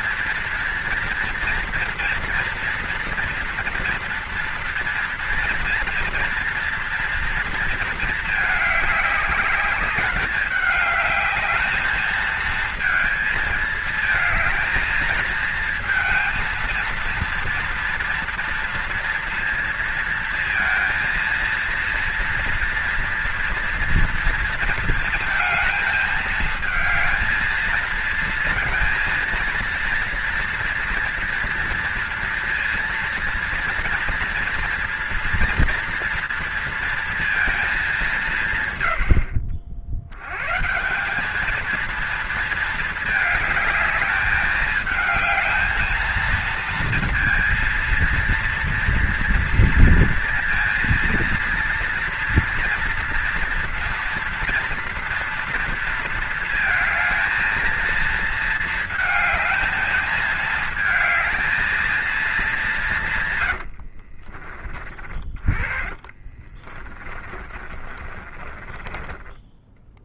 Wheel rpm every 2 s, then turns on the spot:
230, 230, 230, 230, 200, 210, 220, 220, 230, 240, 230, 230, 230, 220, 230, 230, 230, 240, 230, 120, 160, 220, 210, 230, 230, 230, 230, 230, 220, 220, 220, 190, 30, 30, 20.
64-70